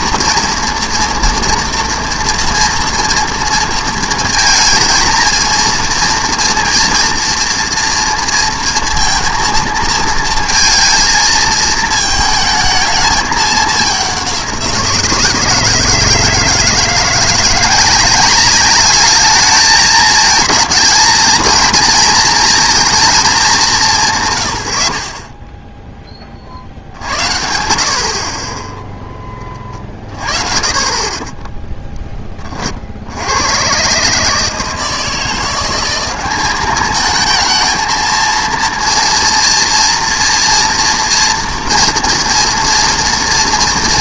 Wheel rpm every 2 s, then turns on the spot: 230, 230, 230, 230, 230, 230, 220, 180, 160, 200, 220, 230, 110, 50, 20, 30, 50, 160, 200, 230, 240, 230.
none